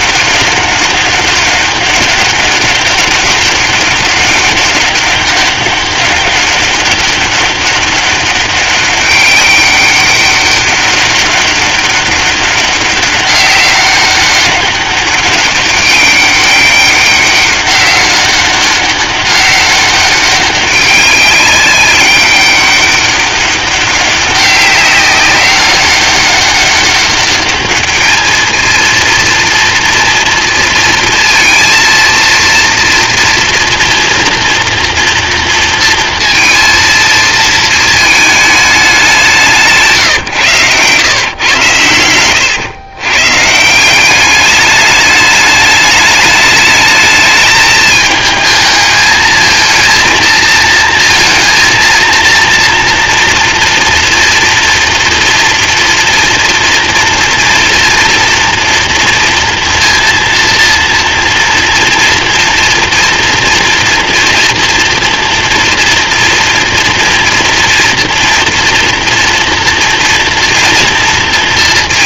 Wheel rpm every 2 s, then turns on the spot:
200, 200, 200, 200, 200, 200, 200, 200, 200, 200, 200, 200, 190, 200, 220, 230, 230, 230, 230, 210, 120, 110, 210, 210, 220, 230, 230, 240, 230, 230, 230, 230, 230, 240, 230, 230.
none